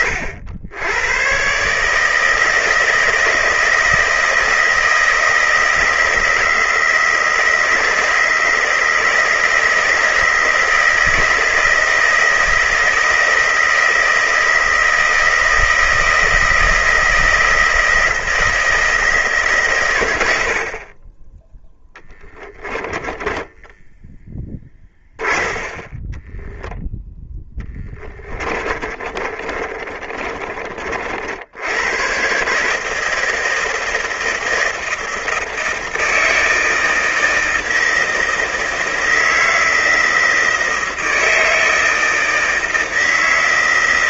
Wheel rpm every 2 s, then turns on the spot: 90, 160, 160, 160, 160, 160, 160, 160, 160, 160, 50, 30, 20, 10, 20, 40, 150, 160, 160, 160, 160, 160.
22-30